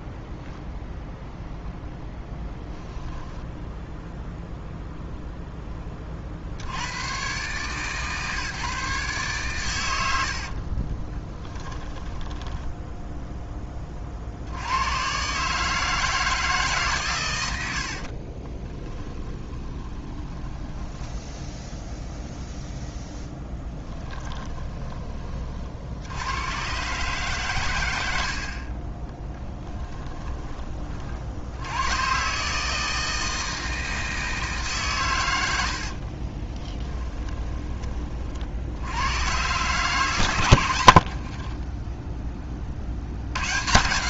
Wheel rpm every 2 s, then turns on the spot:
0, 10, 0, 60, 150, 40, 10, 90, 150, 20, 10, 0, 20, 120, 30, 30, 160, 140, 20, 70, 90, 50.
2-4 10-14 18-22 24-26 28-30 36-38 40-42